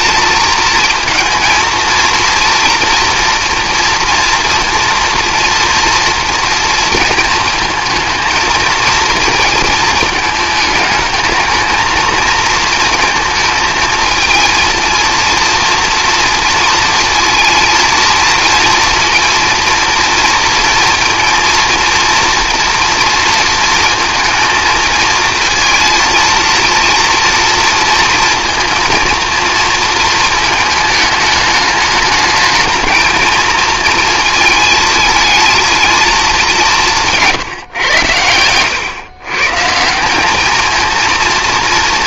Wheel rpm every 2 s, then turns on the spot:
230, 230, 240, 230, 230, 220, 220, 230, 230, 230, 230, 230, 220, 230, 230, 220, 220, 220, 190, 110, 220.
none